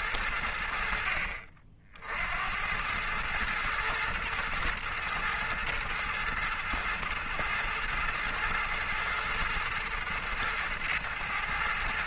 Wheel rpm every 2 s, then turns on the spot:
70, 100, 110, 110, 110, 110.
none